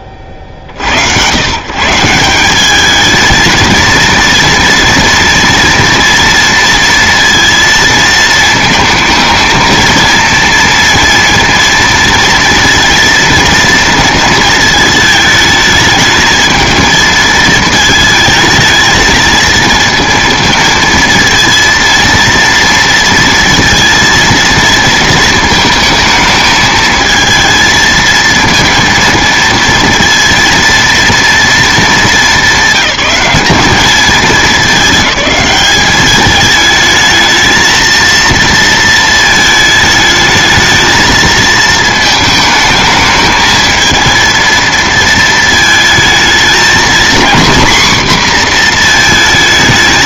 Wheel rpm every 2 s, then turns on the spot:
50, 210, 230, 230, 220, 230, 230, 220, 220, 220, 230, 230, 230, 220, 230, 230, 190, 200, 220, 220, 220, 220, 230, 230, 230.
none